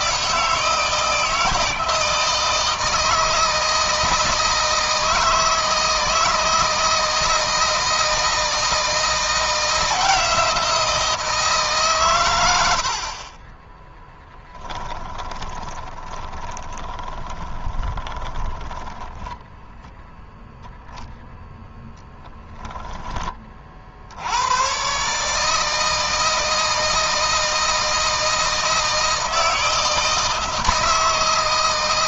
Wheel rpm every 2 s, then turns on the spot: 160, 160, 160, 160, 160, 170, 90, 20, 20, 10, 0, 10, 120, 160, 160, 160.
14-20